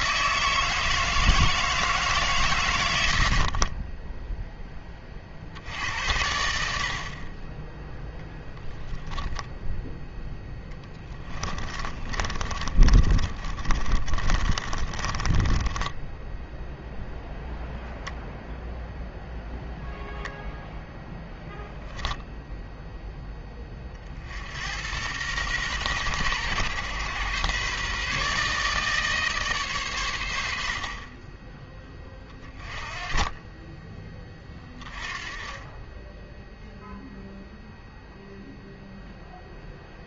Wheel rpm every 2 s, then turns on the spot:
160, 100, 20, 60, 10, 20, 40, 30, 0, 0, 0, 0, 70, 120, 150, 60, 30, 20, 0, 0.
10-16